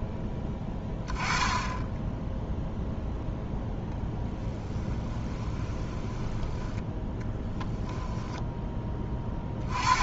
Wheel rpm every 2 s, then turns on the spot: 10, 0, 10, 10, 10.
4-6